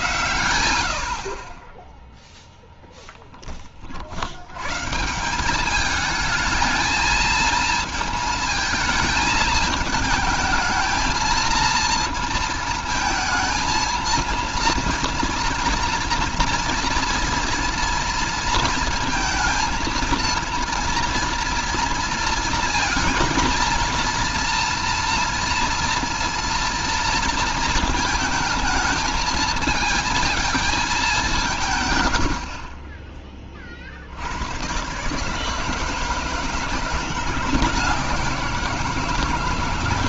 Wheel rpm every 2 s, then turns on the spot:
70, 0, 140, 220, 220, 220, 220, 230, 230, 230, 240, 230, 230, 230, 220, 210, 40, 130, 170, 170.
none